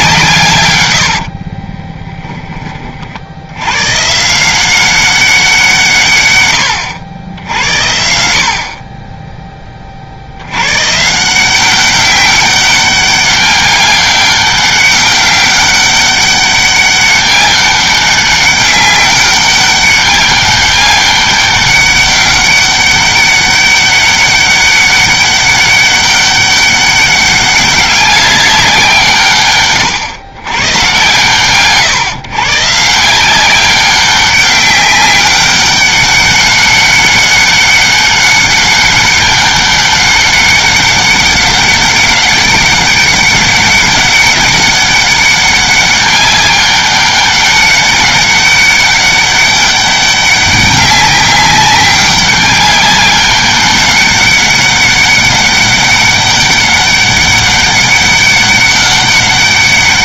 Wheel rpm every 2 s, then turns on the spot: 100, 40, 190, 110, 30, 140, 200, 200, 200, 200, 200, 200, 200, 200, 180, 120, 150, 200, 200, 200, 200, 200, 200, 200, 200, 200, 200, 200, 200, 200.
none